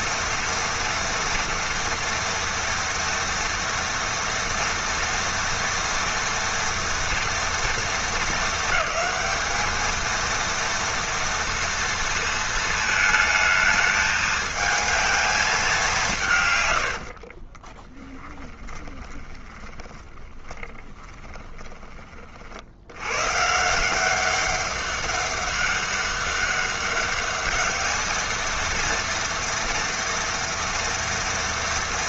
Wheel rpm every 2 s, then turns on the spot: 230, 230, 230, 230, 210, 230, 220, 220, 50, 20, 20, 100, 200, 200, 230, 230.
16-22